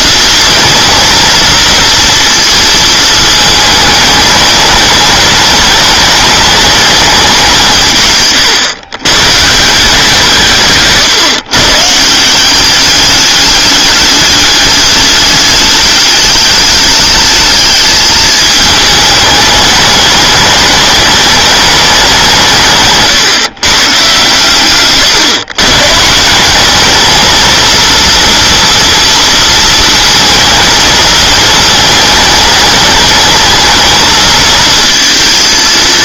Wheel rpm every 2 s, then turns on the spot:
230, 220, 210, 210, 120, 150, 200, 210, 210, 210, 210, 150, 130, 210, 230, 220, 220, 220.
10-12